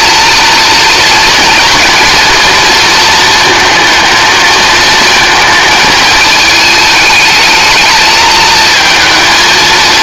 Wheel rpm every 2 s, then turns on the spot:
230, 230, 220, 220, 220.
none